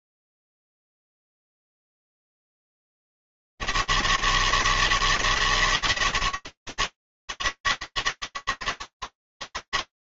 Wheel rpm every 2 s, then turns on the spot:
90, 160, 160, 150, 160.
none